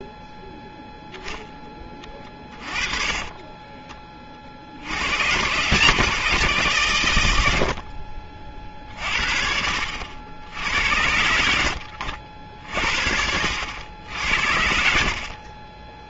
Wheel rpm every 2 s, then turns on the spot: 0, 30, 60, 130, 50, 80, 60, 70.
2-4